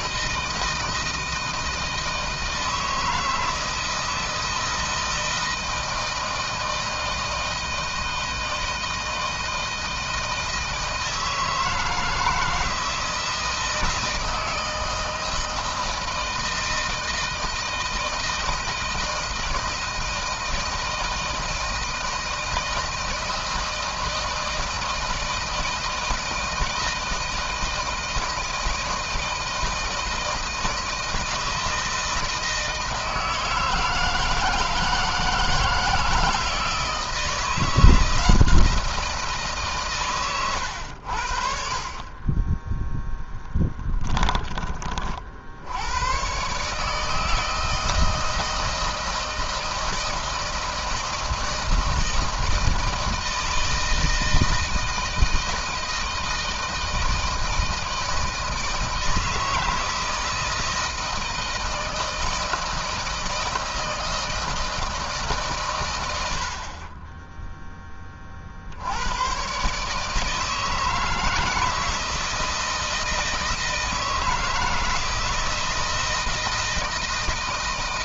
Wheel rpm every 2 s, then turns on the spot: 160, 160, 160, 160, 160, 160, 160, 160, 160, 160, 160, 160, 160, 160, 160, 160, 160, 160, 160, 160, 70, 10, 40, 150, 160, 160, 160, 160, 160, 160, 160, 160, 160, 20, 90, 150, 160, 160, 160.
none